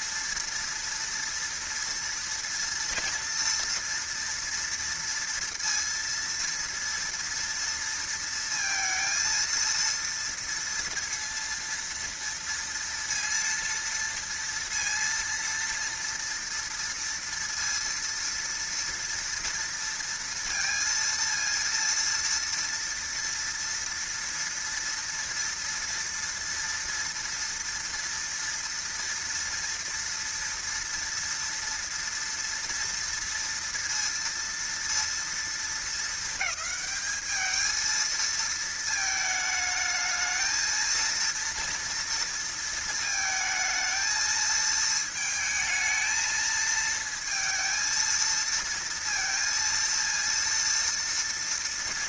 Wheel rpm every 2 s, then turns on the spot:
230, 230, 230, 230, 230, 230, 230, 230, 230, 230, 230, 230, 230, 230, 230, 230, 230, 230, 210, 220, 220, 230, 220, 220, 230, 230.
none